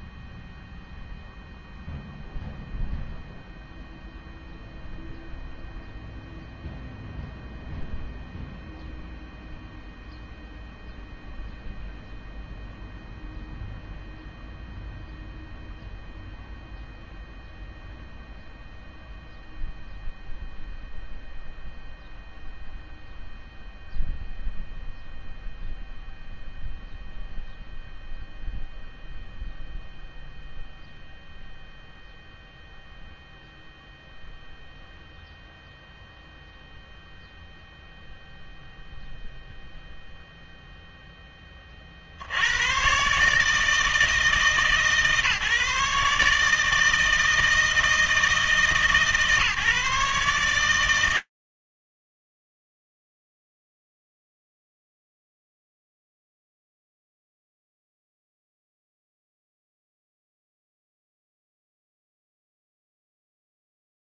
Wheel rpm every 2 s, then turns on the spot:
0, 0, 0, 0, 0, 0, 0, 0, 0, 0, 0, 0, 0, 0, 0, 0, 0, 0, 0, 0, 0, 120, 150, 160, 150, 120, 90, 40, 0, 0, 20, 70.
none